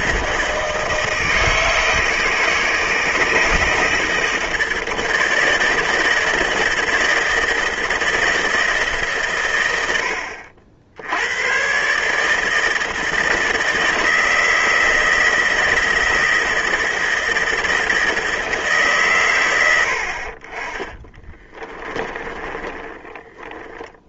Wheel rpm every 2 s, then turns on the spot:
160, 160, 160, 160, 150, 90, 160, 160, 160, 150, 30, 10.
22-24